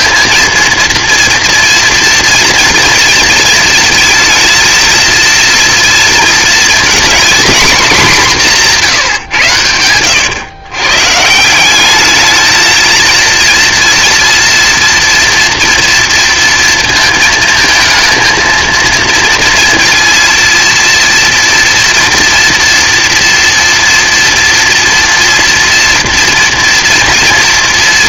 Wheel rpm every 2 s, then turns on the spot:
230, 230, 230, 230, 180, 120, 220, 230, 230, 230, 230, 230, 230, 230.
none